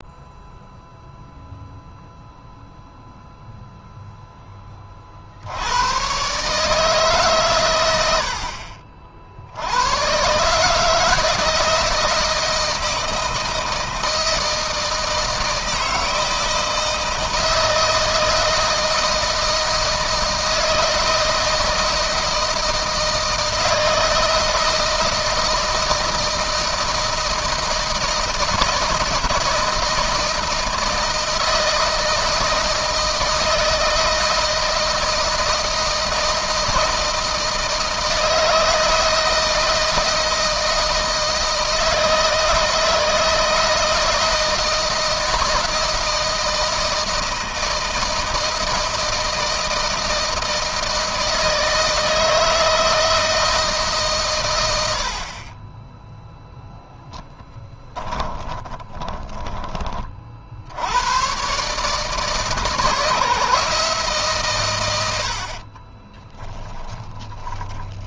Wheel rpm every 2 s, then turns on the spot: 0, 0, 50, 140, 60, 160, 160, 160, 160, 160, 160, 160, 160, 160, 160, 160, 160, 160, 160, 160, 160, 160, 160, 160, 160, 160, 160, 60, 10, 20, 110, 150, 80, 10.
56-60 66-68